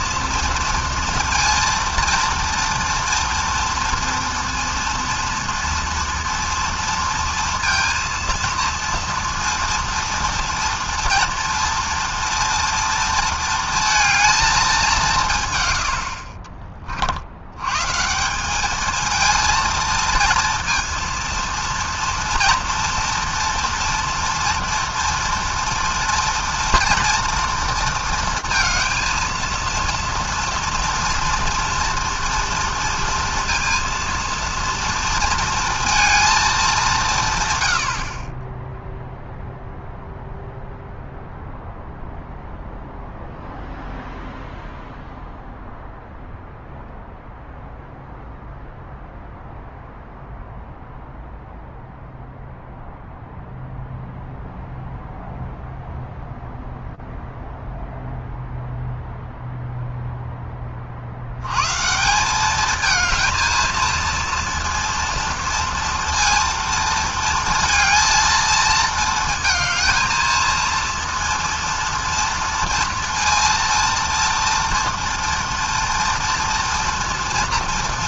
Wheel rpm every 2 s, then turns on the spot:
230, 230, 230, 230, 230, 240, 230, 220, 60, 200, 230, 230, 230, 230, 230, 230, 230, 230, 220, 20, 0, 0, 0, 0, 0, 0, 0, 0, 0, 0, 20, 210, 230, 230, 230, 230, 230, 230, 230.
none